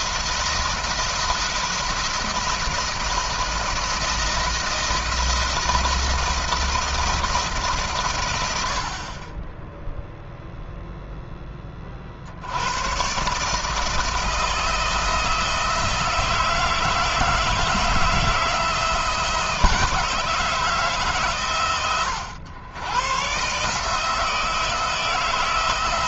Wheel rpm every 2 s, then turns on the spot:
160, 160, 160, 170, 60, 0, 110, 160, 160, 160, 150, 110, 160.
none